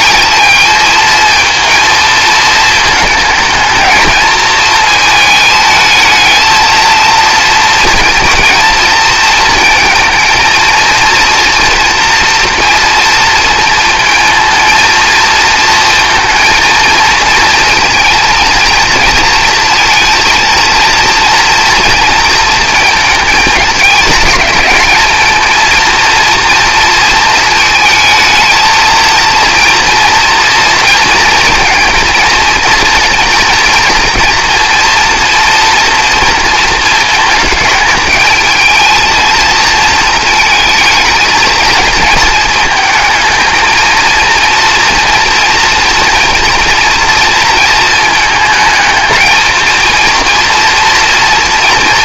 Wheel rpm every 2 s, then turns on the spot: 220, 220, 230, 230, 230, 230, 230, 220, 230, 230, 230, 220, 230, 230, 230, 230, 230, 230, 230, 220, 220, 230, 230, 220, 230, 190.
none